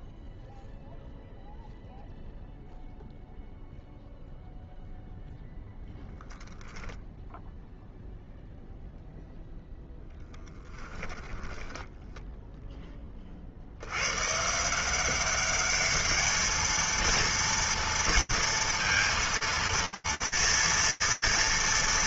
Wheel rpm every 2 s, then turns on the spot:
0, 0, 0, 0, 0, 10, 40, 190, 230, 230, 230.
10-12